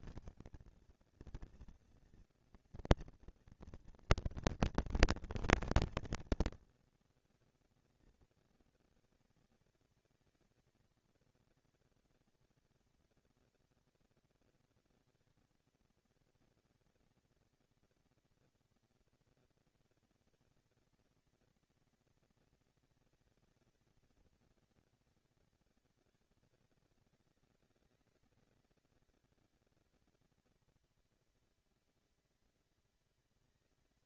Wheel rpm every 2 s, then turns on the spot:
230, 230, 230, 230, 230, 230, 230, 230, 230, 230, 230, 230, 230, 200, 200, 220, 230.
none